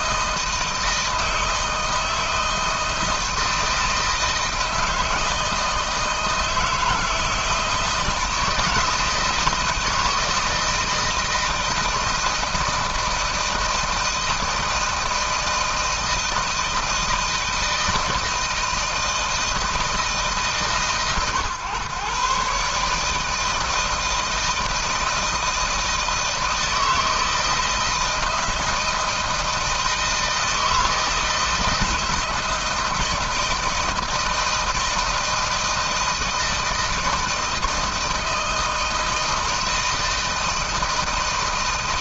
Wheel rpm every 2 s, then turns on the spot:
160, 160, 160, 160, 160, 160, 160, 160, 160, 160, 140, 150, 160, 160, 160, 160, 170, 160, 160, 160, 160.
none